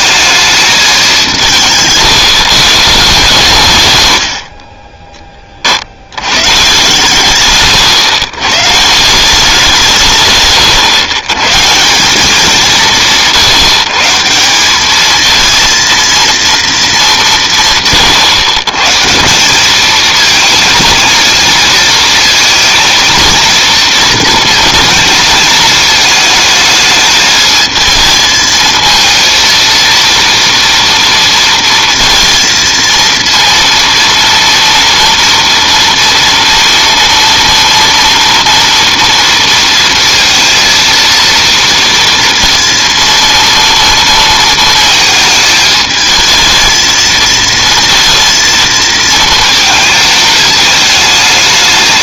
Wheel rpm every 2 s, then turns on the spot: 220, 150, 60, 130, 140, 120, 180, 190, 230, 130, 220, 230, 230, 220, 220, 240, 230, 230, 230, 230, 230, 230, 230, 220, 230, 220.
none